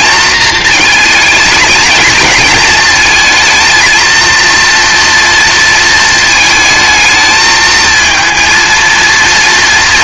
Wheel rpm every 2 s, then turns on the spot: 220, 220, 230, 220, 230.
none